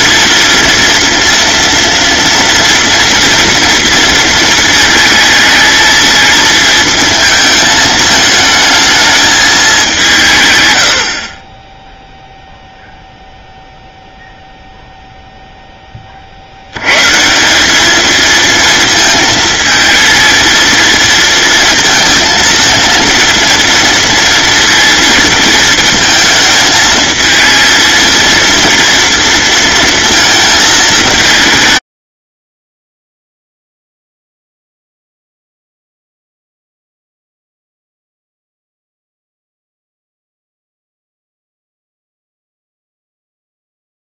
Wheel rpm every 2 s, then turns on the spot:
230, 230, 220, 220, 220, 120, 0, 0, 80, 230, 230, 230, 230, 220, 230, 220, 90, 0, 0, 0, 0, 0.
none